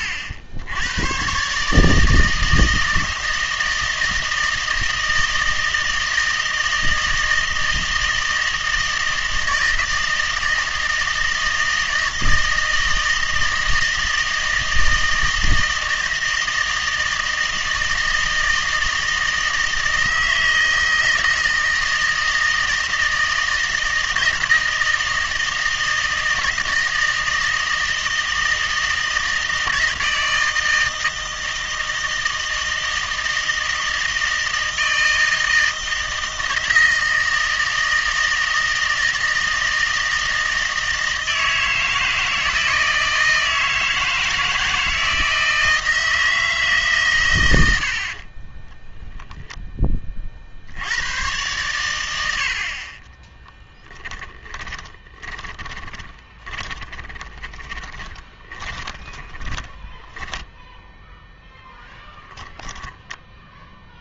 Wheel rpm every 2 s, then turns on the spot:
90, 160, 160, 160, 160, 160, 160, 160, 160, 160, 160, 160, 160, 160, 160, 160, 160, 160, 160, 160, 160, 160, 160, 150, 10, 80, 40, 20, 20, 10, 0, 10.
54-60